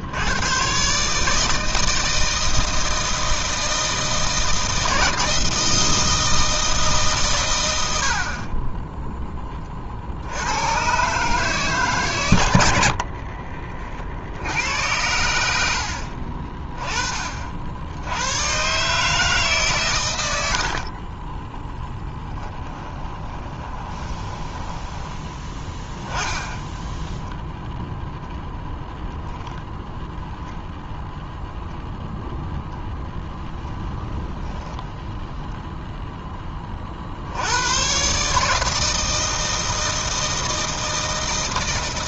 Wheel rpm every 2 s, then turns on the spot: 130, 160, 160, 150, 10, 130, 70, 80, 30, 140, 50, 10, 10, 10, 0, 0, 0, 0, 40, 160, 160.
8-10 12-14 20-26